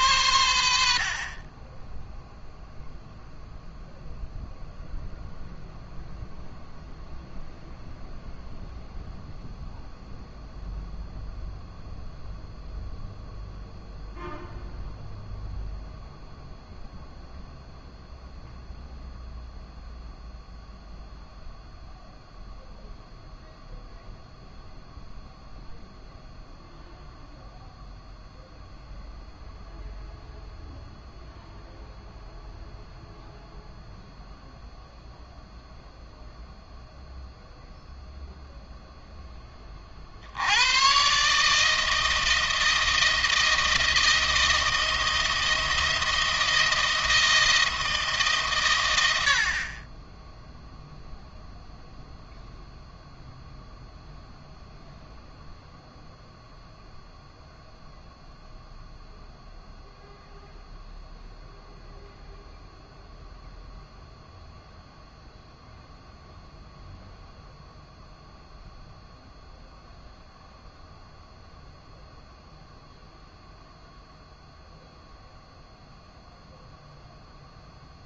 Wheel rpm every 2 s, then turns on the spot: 80, 0, 0, 0, 0, 0, 0, 0, 0, 0, 0, 0, 0, 0, 0, 0, 0, 0, 0, 0, 80, 160, 170, 160, 130, 0, 0, 0, 0, 0, 0, 0, 0, 0, 0, 0, 0, 0, 0.
none